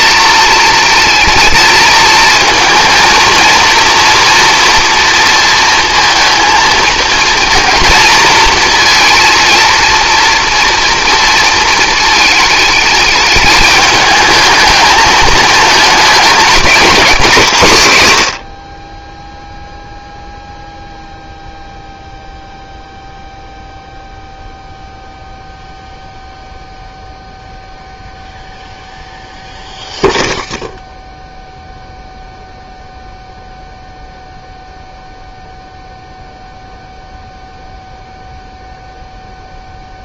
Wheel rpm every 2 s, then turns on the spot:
230, 230, 230, 220, 230, 240, 210, 220, 210, 60, 0, 0, 0, 0, 0, 0, 0, 0, 0, 0.
none